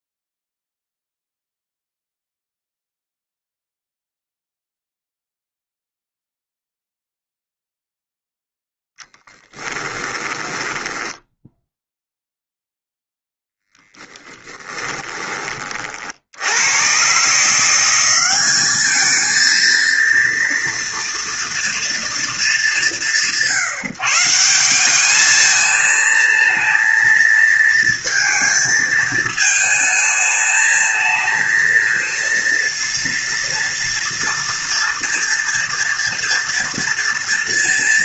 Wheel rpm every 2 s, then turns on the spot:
0, 0, 0, 0, 0, 10, 0, 10, 120, 220, 230, 170, 200, 230, 220, 220, 230, 230, 230.
10-12 14-16